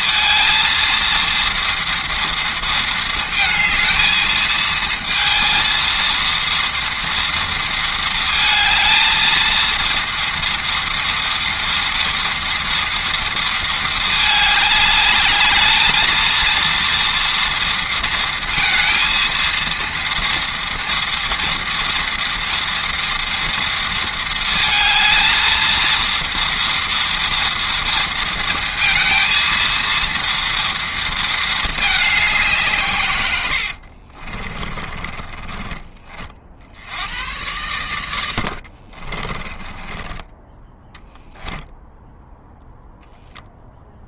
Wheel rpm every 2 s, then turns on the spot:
230, 230, 220, 230, 220, 230, 230, 210, 230, 230, 230, 230, 220, 230, 230, 230, 150, 20, 70, 60, 10, 0.
34-36 38-40